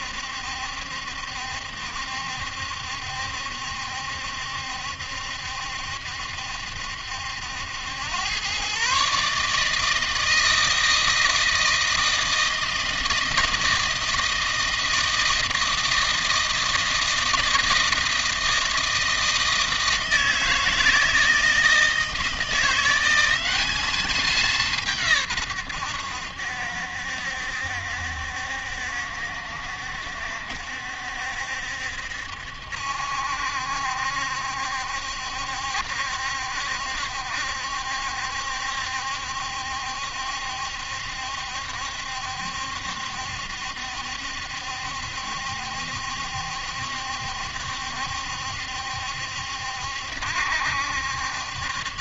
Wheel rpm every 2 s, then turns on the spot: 70, 70, 70, 70, 120, 160, 160, 160, 160, 160, 160, 170, 190, 80, 70, 70, 70, 70, 70, 70, 70, 70, 70, 70, 70, 70.
none